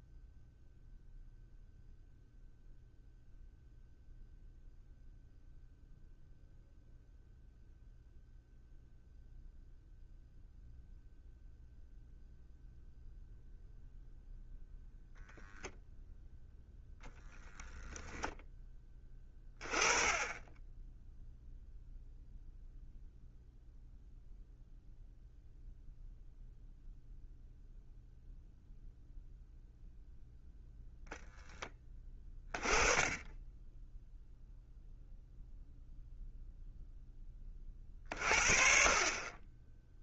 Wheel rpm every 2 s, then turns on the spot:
0, 0, 0, 0, 0, 0, 0, 0, 0, 10, 10, 0, 0, 0, 0, 0, 20, 0, 0, 40.
none